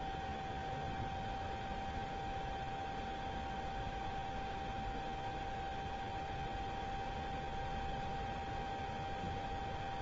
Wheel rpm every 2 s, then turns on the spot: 0, 0, 0, 0, 0.
none